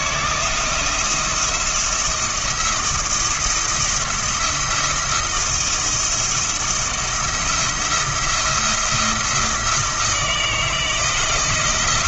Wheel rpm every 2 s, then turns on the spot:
170, 170, 170, 170, 170, 160.
none